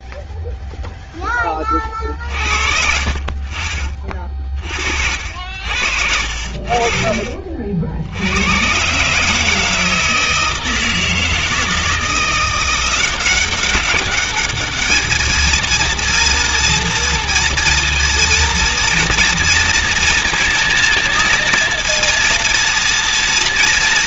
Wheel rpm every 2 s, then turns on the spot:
0, 50, 60, 40, 120, 160, 180, 210, 230, 230, 230, 230.
none